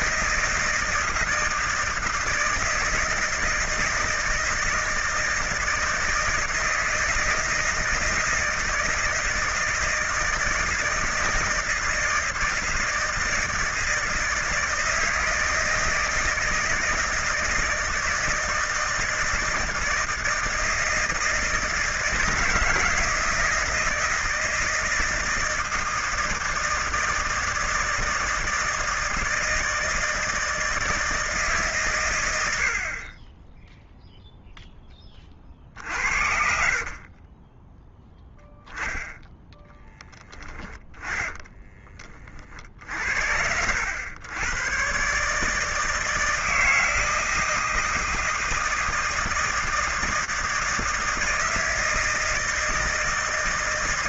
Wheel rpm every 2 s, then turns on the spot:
160, 160, 160, 160, 160, 160, 160, 160, 160, 160, 160, 160, 160, 160, 160, 160, 40, 20, 40, 10, 10, 70, 130, 160, 160, 160, 160.
36-38